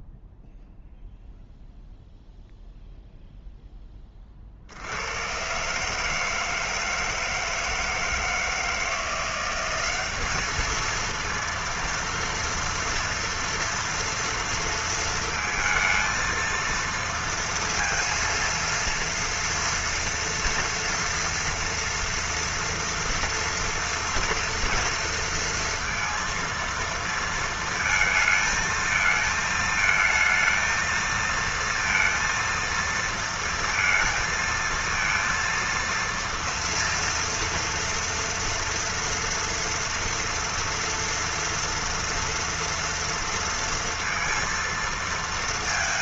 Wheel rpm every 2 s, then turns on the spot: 0, 0, 70, 160, 160, 220, 230, 230, 230, 230, 230, 230, 230, 230, 220, 230, 230, 230, 230, 230, 230, 230, 230.
none